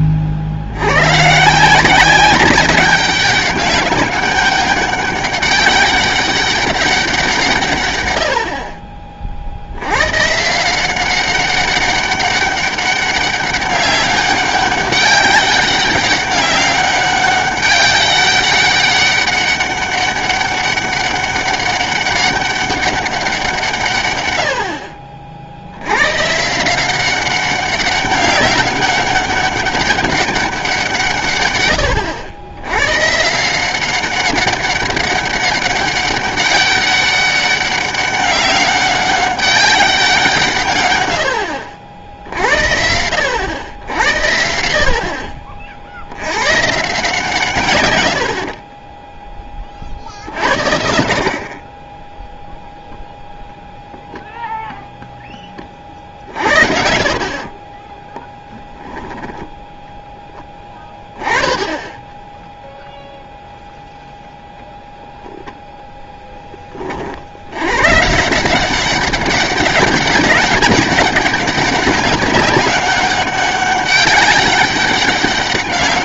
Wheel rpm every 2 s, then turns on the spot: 80, 200, 200, 190, 30, 170, 200, 200, 200, 200, 200, 200, 70, 170, 200, 180, 110, 190, 200, 200, 130, 80, 70, 140, 40, 60, 0, 0, 50, 20, 20, 0, 0, 30, 190, 200, 190, 200.
48-50